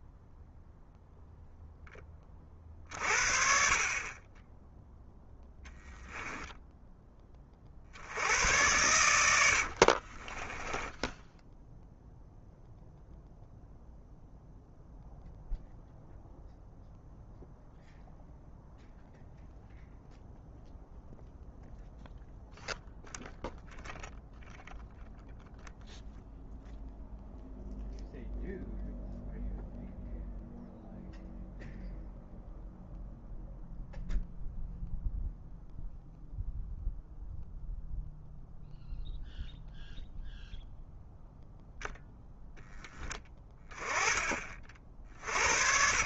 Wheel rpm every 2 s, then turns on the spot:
0, 40, 10, 10, 100, 10, 0, 0, 0, 0, 0, 0, 0, 0, 0, 0, 0, 0, 0, 0, 0, 10, 50.
10-12